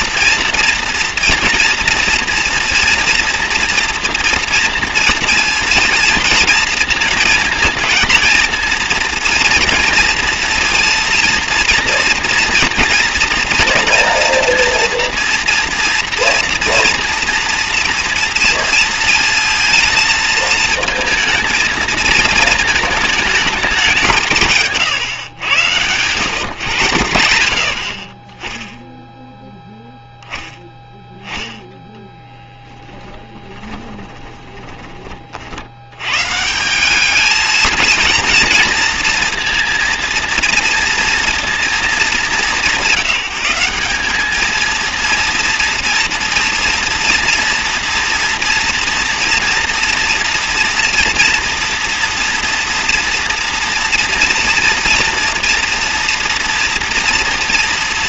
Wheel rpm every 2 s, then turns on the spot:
230, 230, 230, 230, 230, 230, 230, 230, 230, 230, 220, 220, 150, 140, 10, 10, 10, 20, 170, 230, 230, 200, 220, 230, 240, 230, 230, 230, 230.
24-26 34-36